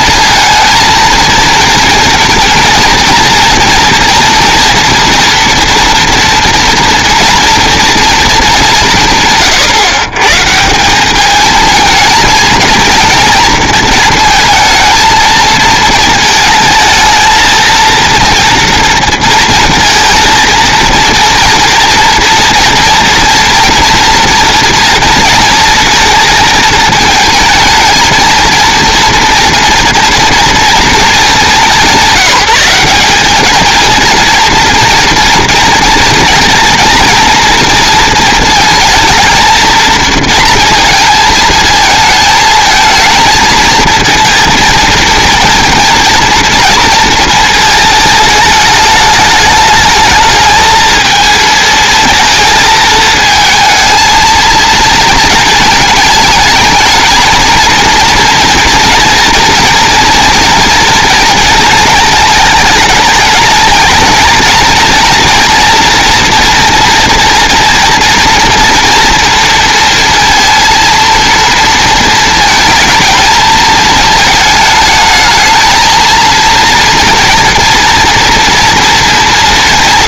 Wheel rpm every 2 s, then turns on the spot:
230, 230, 230, 230, 180, 180, 230, 230, 220, 230, 230, 240, 240, 220, 230, 220, 190, 230, 230, 230, 230, 220, 230, 230, 210, 220, 220, 230, 220, 240, 230, 210, 230, 230, 230, 230, 220, 220, 230, 230.
none